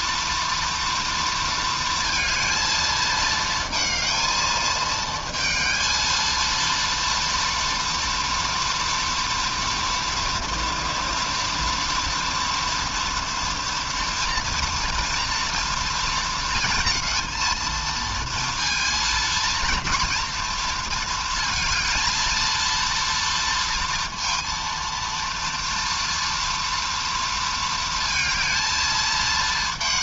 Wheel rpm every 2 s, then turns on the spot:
230, 230, 220, 230, 230, 230, 230, 230, 230, 230, 230, 230, 230, 230, 220.
none